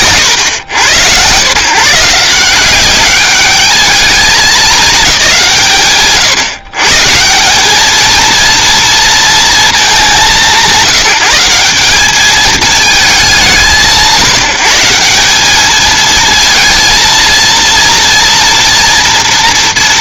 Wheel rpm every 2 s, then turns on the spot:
130, 180, 220, 90, 230, 150, 220, 150, 230, 240.
none